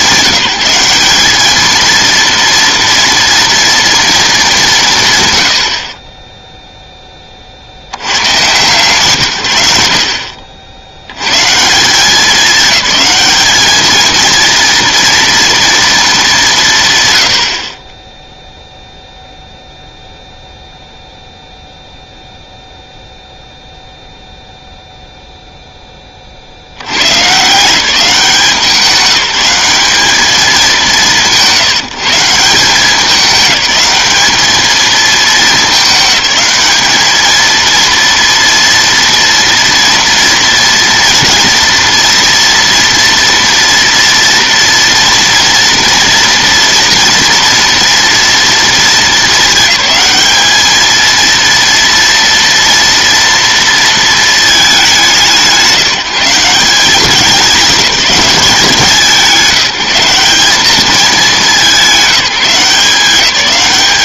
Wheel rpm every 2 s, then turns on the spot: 190, 230, 190, 0, 140, 70, 200, 230, 160, 0, 0, 0, 0, 90, 180, 190, 190, 220, 210, 230, 230, 230, 230, 230, 230, 220, 230, 210, 190, 180, 200, 180.
none